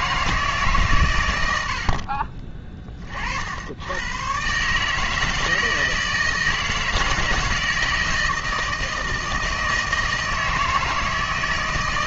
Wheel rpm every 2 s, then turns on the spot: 150, 40, 130, 160, 160, 160.
none